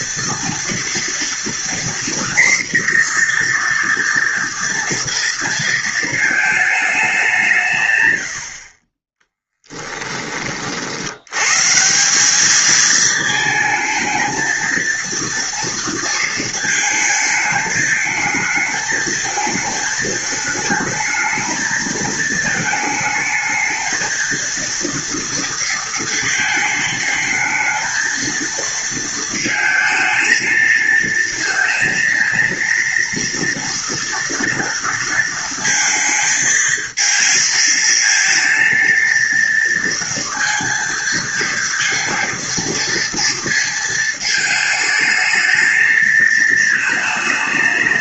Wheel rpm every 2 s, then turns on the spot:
230, 240, 230, 220, 50, 50, 220, 230, 220, 220, 220, 220, 230, 220, 230, 230, 230, 230, 230, 230, 230, 230, 220, 220.
none